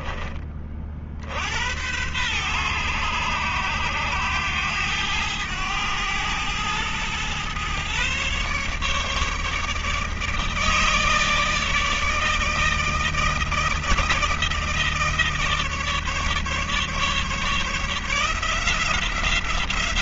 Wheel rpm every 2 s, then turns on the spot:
40, 100, 100, 110, 140, 160, 160, 160, 150, 170.
none